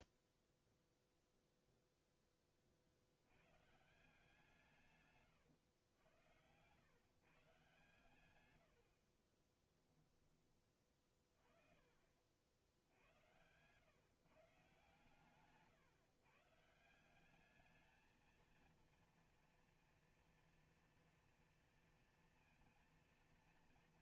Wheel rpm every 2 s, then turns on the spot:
0, 40, 160, 120, 80, 20, 70, 140, 160, 230, 230, 230.
none